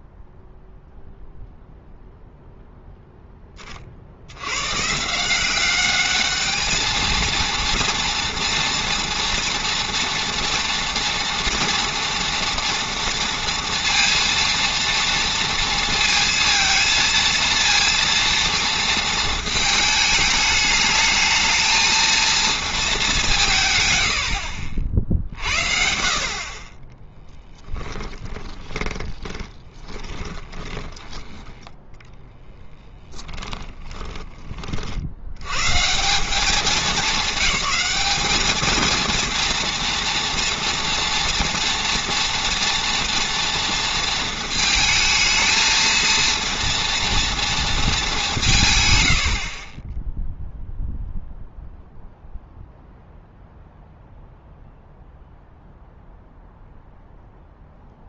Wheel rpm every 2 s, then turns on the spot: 0, 0, 110, 210, 240, 230, 230, 230, 230, 230, 220, 220, 50, 30, 20, 20, 20, 30, 210, 220, 230, 240, 230, 230, 160, 0, 0, 0, 0.
28-34